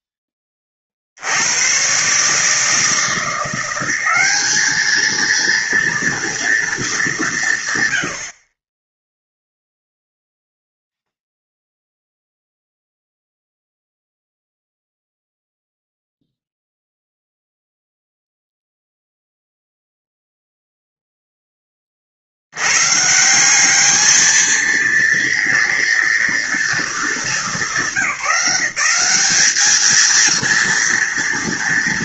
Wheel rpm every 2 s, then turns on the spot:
30, 160, 210, 220, 20, 0, 0, 0, 0, 0, 0, 110, 220, 230, 180, 230.
none